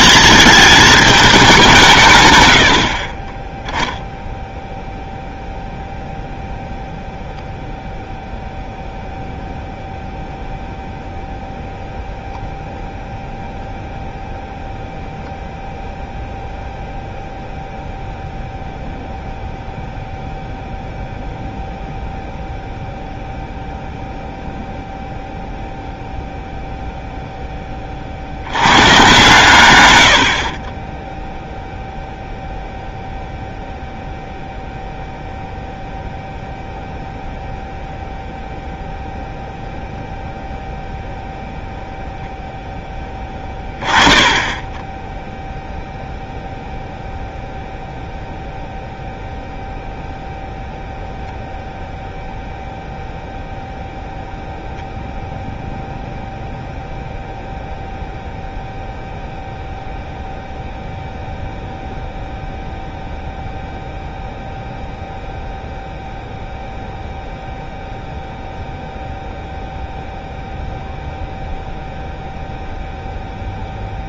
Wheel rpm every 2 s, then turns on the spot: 220, 80, 0, 0, 0, 0, 0, 0, 0, 0, 0, 0, 0, 0, 110, 40, 0, 0, 0, 0, 0, 0, 20, 0, 0, 0, 0, 0, 0, 0, 0, 0, 0, 0, 0, 0, 0.
none